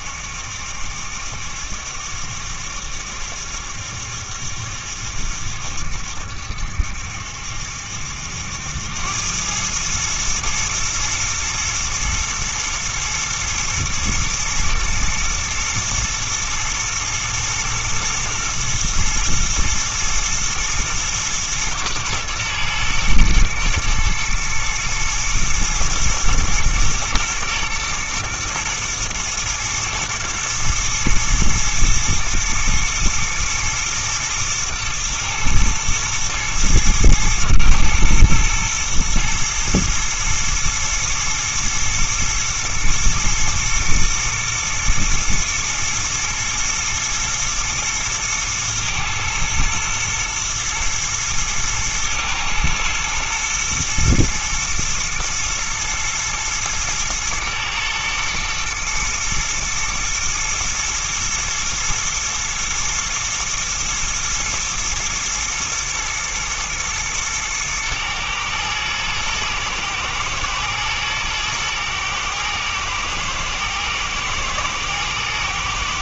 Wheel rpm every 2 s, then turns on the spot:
70, 70, 70, 70, 90, 110, 110, 110, 120, 110, 110, 110, 110, 120, 110, 110, 110, 110, 110, 120, 110, 120, 110, 120, 120, 110, 120, 120, 110, 120, 120, 120, 120, 110, 110, 120, 120, 110.
none